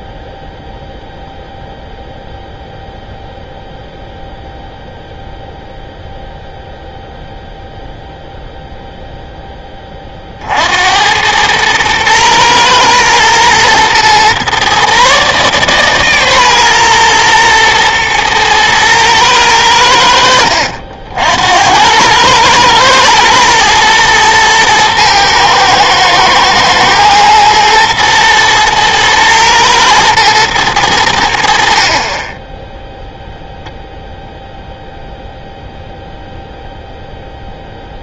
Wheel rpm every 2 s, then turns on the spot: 0, 0, 0, 0, 0, 60, 120, 130, 130, 110, 70, 110, 110, 110, 110, 110, 10, 0, 0.
none